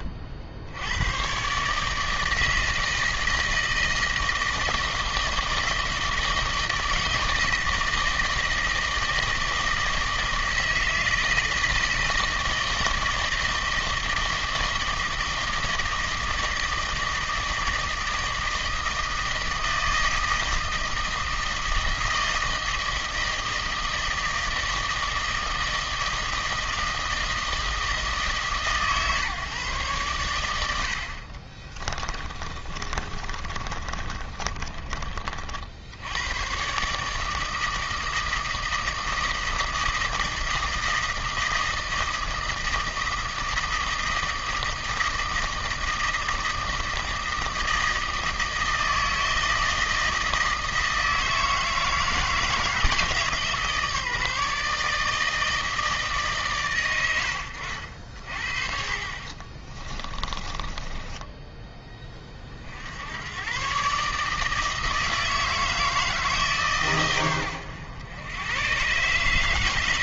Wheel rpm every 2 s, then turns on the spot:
60, 160, 160, 160, 160, 160, 160, 160, 160, 160, 160, 160, 160, 160, 140, 70, 30, 30, 130, 160, 160, 160, 160, 160, 160, 160, 160, 150, 110, 50, 20, 60, 160, 140, 120.
32-36 60-62